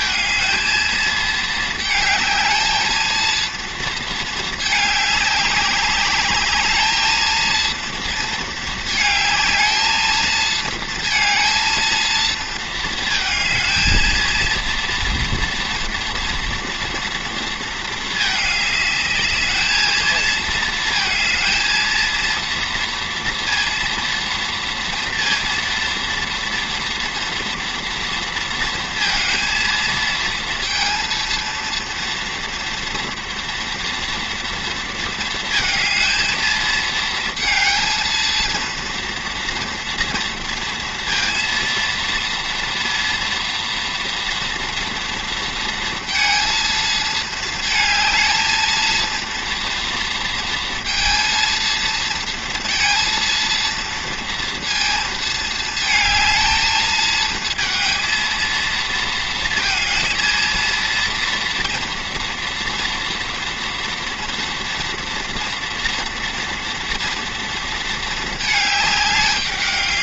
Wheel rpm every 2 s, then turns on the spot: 230, 220, 210, 210, 220, 230, 220, 230, 230, 210, 230, 230, 230, 240, 230, 230, 240, 230, 220, 230, 230, 230, 240, 230, 220, 230, 230, 230, 220, 230, 230, 240, 230, 230, 220.
none